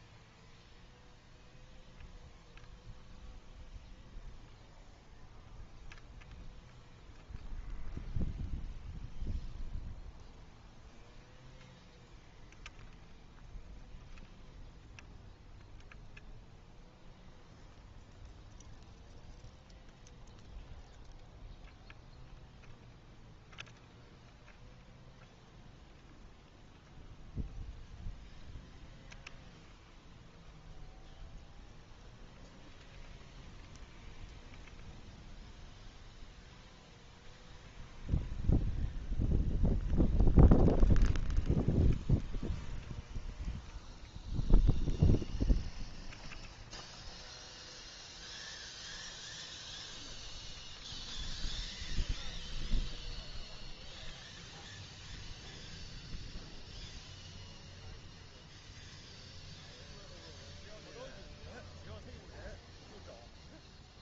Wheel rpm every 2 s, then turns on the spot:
0, 0, 0, 0, 0, 0, 0, 0, 0, 0, 0, 0, 0, 0, 0, 0, 0, 0, 0, 0, 0, 0, 0, 0, 0, 0, 0, 0, 0, 0, 0, 0.
none